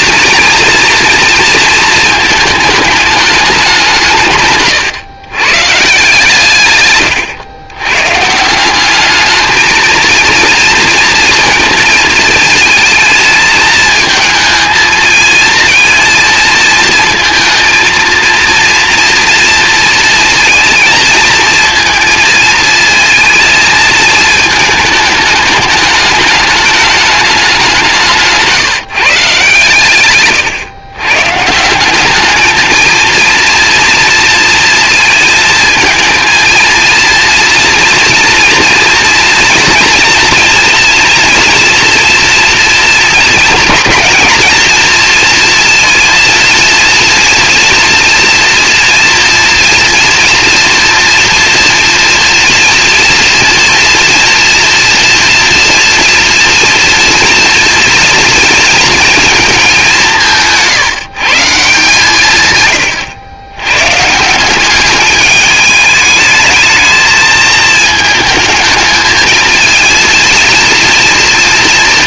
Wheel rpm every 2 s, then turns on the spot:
230, 220, 140, 130, 190, 230, 220, 220, 220, 230, 230, 230, 220, 210, 160, 120, 230, 230, 230, 230, 230, 230, 230, 240, 240, 230, 230, 230, 230, 230, 160, 100, 200, 220, 220, 230.
62-64